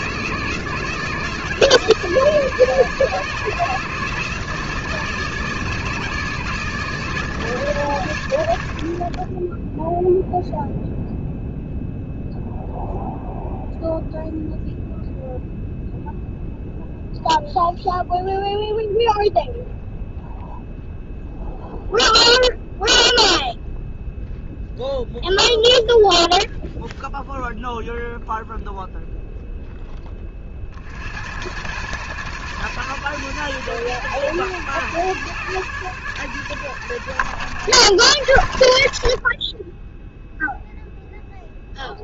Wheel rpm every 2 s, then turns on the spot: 160, 150, 150, 150, 40, 0, 0, 0, 0, 0, 0, 0, 0, 0, 0, 70, 130, 130, 130, 70, 0.
none